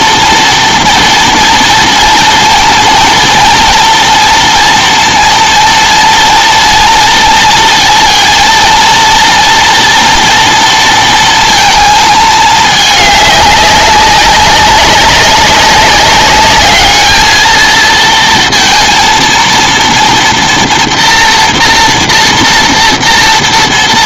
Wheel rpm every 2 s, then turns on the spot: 230, 230, 230, 230, 230, 230, 210, 190, 210, 230, 230, 230.
none